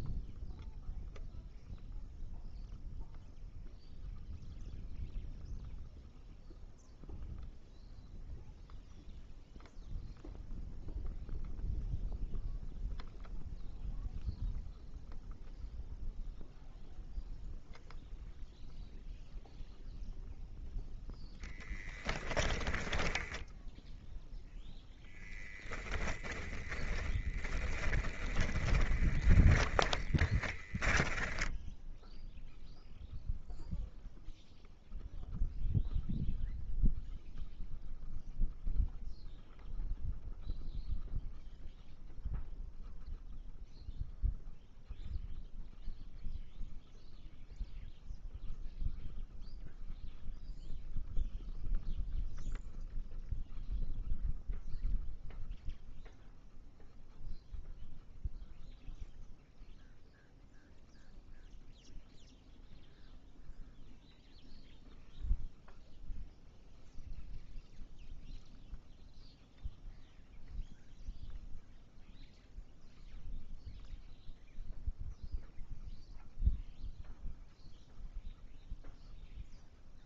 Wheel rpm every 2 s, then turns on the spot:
0, 0, 0, 0, 0, 0, 0, 0, 0, 0, 0, 10, 10, 10, 20, 20, 0, 0, 0, 0, 0, 0, 0, 0, 0, 0, 0, 0, 0, 0, 0, 0, 0, 0, 0, 0, 0, 0, 0, 0.
22-24 26-32